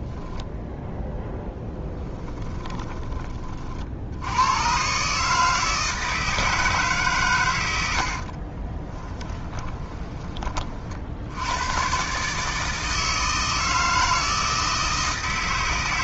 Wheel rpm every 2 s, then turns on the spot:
10, 30, 150, 120, 10, 80, 160, 160.
8-10